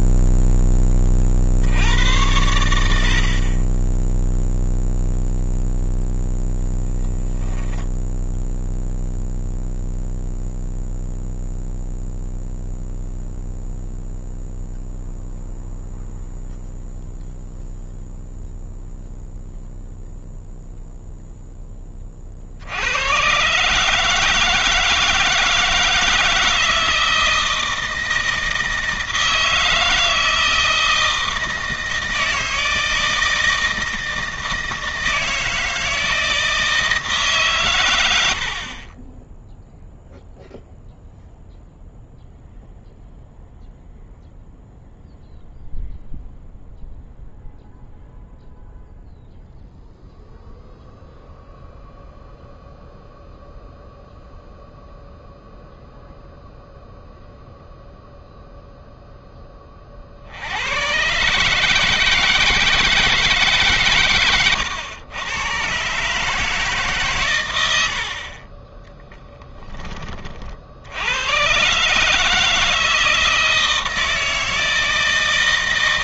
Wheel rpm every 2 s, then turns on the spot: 10, 80, 0, 0, 0, 0, 0, 0, 0, 0, 0, 100, 160, 160, 160, 160, 160, 160, 160, 30, 0, 0, 0, 0, 0, 0, 0, 0, 0, 0, 110, 160, 110, 140, 10, 70, 160, 160.
68-70